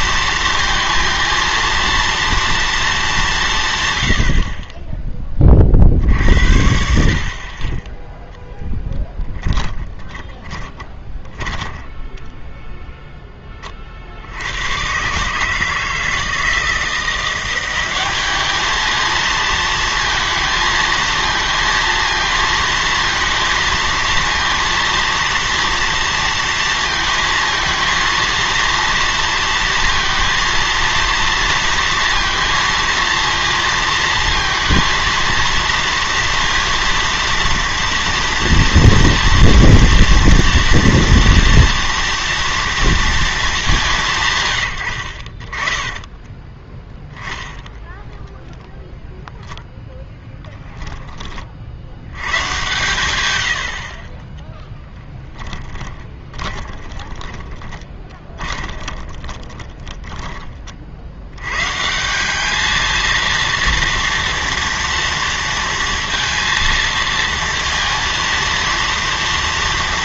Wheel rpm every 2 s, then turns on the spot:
230, 230, 40, 70, 0, 10, 0, 110, 170, 210, 220, 230, 230, 230, 230, 230, 230, 230, 230, 230, 230, 230, 100, 10, 0, 10, 120, 10, 20, 20, 40, 220, 230, 230, 230.
10-12 46-48 54-60